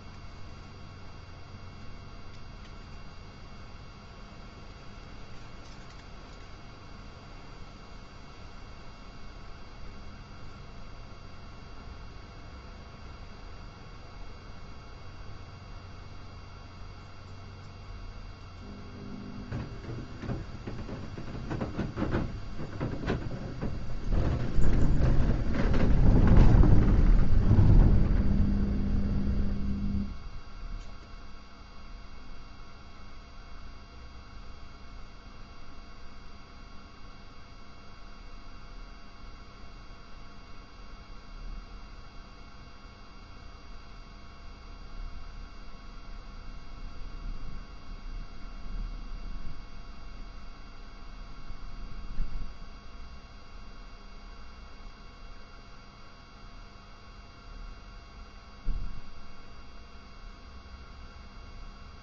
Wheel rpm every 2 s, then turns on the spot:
0, 0, 0, 0, 0, 0, 0, 0, 0, 0, 0, 0, 0, 0, 0, 0, 0, 0, 0, 0, 0, 0, 0, 0, 0, 0, 0, 0, 0, 0, 0.
none